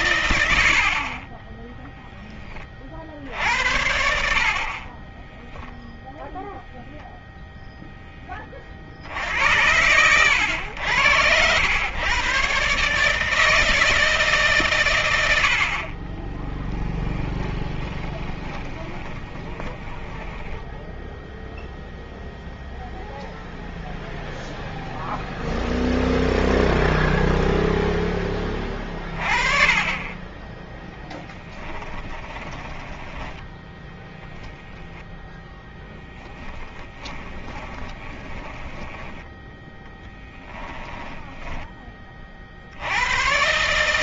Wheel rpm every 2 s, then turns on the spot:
50, 50, 20, 10, 60, 90, 150, 110, 30, 20, 10, 0, 0, 0, 30, 10, 10, 0, 20, 10, 10, 100.
2-6 16-20 30-32 36-42